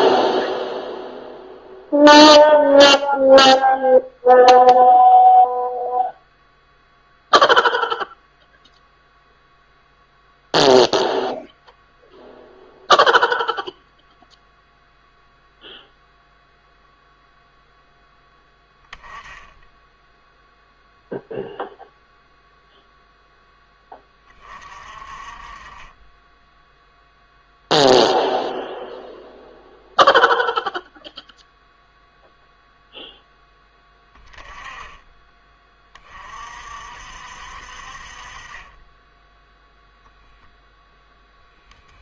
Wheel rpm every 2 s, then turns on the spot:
0, 0, 0, 0, 0, 0, 0, 0, 0, 10, 0, 0, 40, 0, 0, 0, 0, 20, 50, 20, 0.
none